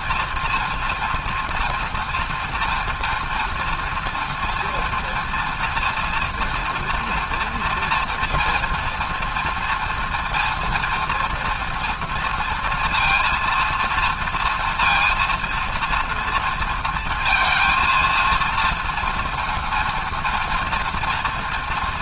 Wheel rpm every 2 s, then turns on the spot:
230, 230, 230, 230, 230, 230, 230, 230, 230, 230, 240.
none